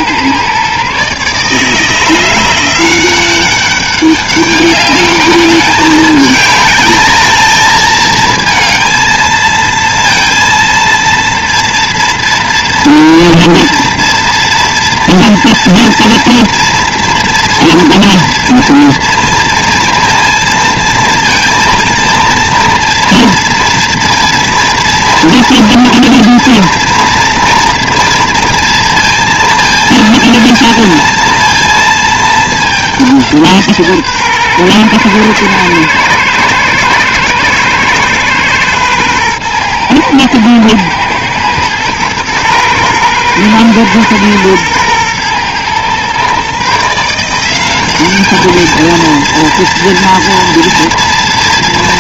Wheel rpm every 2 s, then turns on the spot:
130, 180, 200, 210, 220, 230, 230, 230, 230, 230, 230, 230, 230, 230, 230, 230, 210, 120, 110, 120, 110, 120, 120, 150, 220, 230.
none